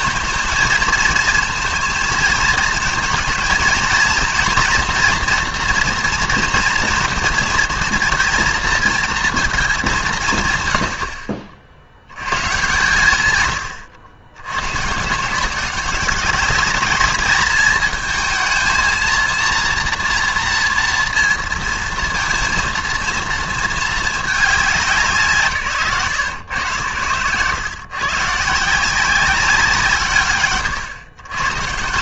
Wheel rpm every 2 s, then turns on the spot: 220, 220, 230, 230, 230, 130, 130, 100, 200, 230, 230, 230, 200, 120, 140, 110.
none